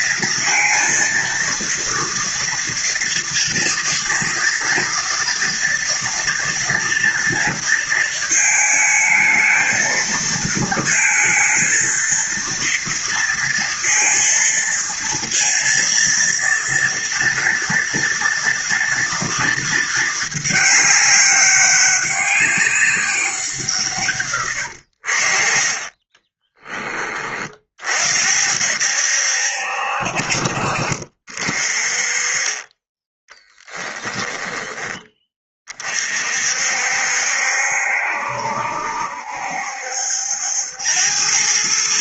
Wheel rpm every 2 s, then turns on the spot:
230, 230, 230, 230, 220, 230, 230, 230, 230, 230, 220, 200, 120, 20, 60, 60, 30, 10, 50, 70, 80.
26-28 34-36